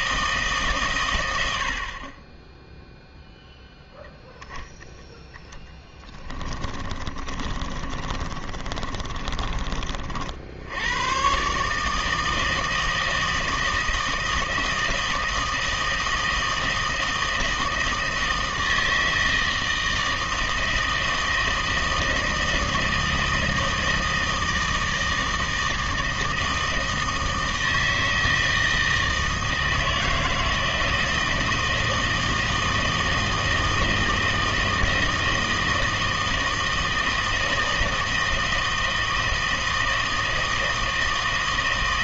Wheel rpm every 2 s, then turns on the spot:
140, 10, 0, 20, 30, 80, 160, 160, 160, 160, 160, 160, 160, 160, 160, 160, 160, 160, 160, 160, 160.
6-10